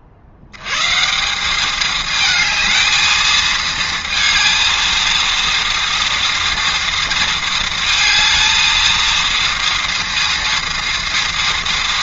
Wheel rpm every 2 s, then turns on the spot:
80, 220, 230, 230, 220, 230.
none